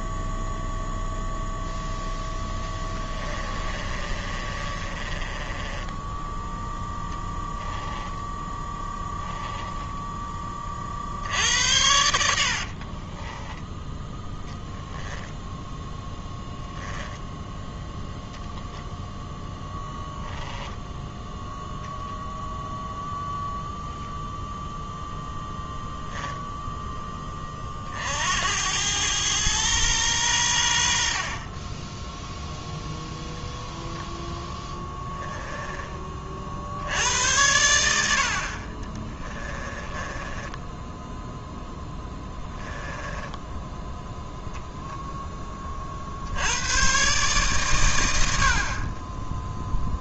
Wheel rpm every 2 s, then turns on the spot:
0, 10, 30, 10, 10, 40, 40, 20, 0, 10, 10, 0, 0, 10, 100, 70, 0, 10, 70, 40, 10, 10, 0, 110, 50.
2-6 8-10 12-16 20-22 34-36 38-44